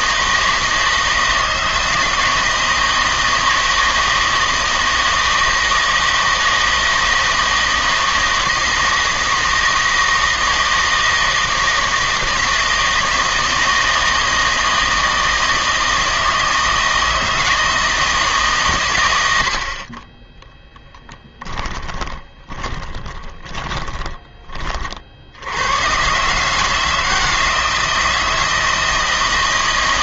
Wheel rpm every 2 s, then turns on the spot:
160, 160, 160, 160, 160, 160, 160, 160, 160, 140, 10, 20, 30, 150, 160.
20-24